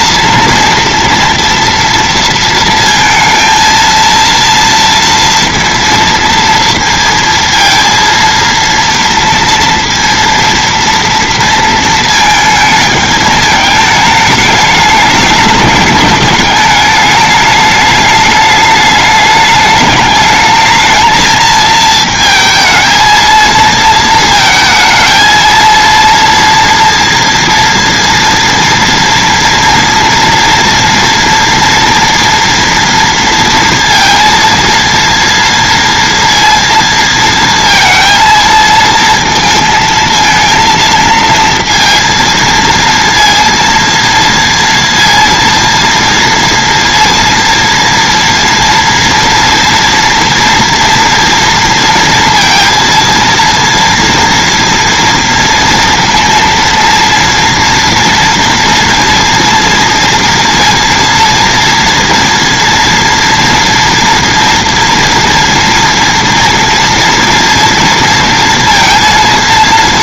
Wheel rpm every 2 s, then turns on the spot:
230, 230, 230, 230, 230, 230, 220, 210, 210, 210, 220, 220, 220, 230, 230, 230, 230, 230, 230, 230, 230, 230, 230, 230, 230, 230, 230, 230, 230, 230, 230, 230, 230, 230, 230.
none